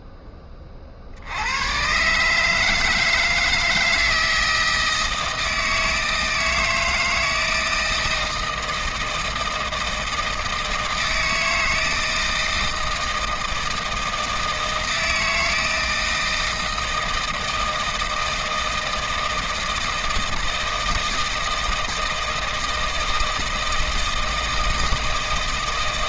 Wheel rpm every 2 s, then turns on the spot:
40, 160, 160, 160, 160, 160, 160, 160, 160, 160, 160, 160, 160.
none